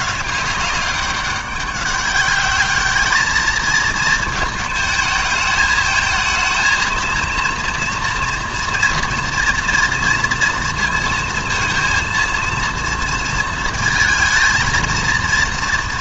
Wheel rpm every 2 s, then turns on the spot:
200, 210, 220, 220, 230, 230, 230, 230.
none